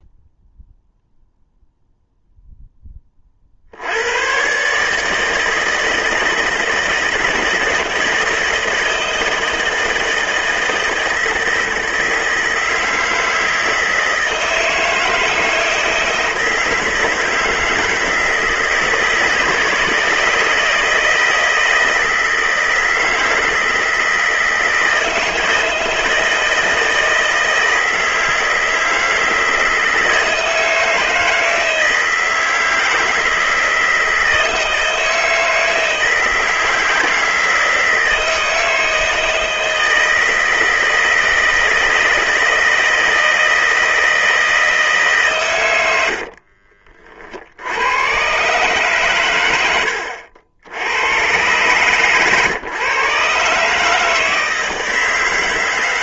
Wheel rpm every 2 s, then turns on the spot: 0, 10, 150, 160, 160, 160, 160, 160, 160, 160, 170, 170, 160, 160, 160, 160, 160, 160, 160, 160, 160, 160, 150, 50, 120, 90, 140, 160.
none